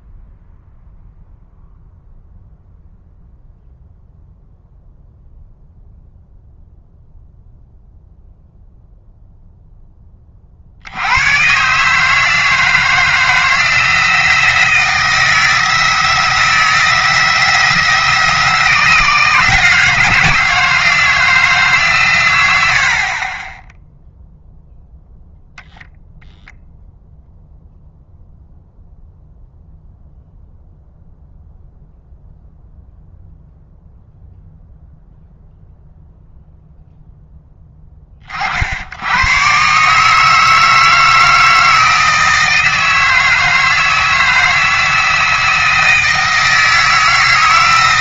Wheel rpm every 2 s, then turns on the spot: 0, 0, 0, 0, 0, 70, 160, 170, 170, 170, 160, 70, 0, 0, 0, 0, 0, 0, 0, 80, 160, 160, 160, 160.
none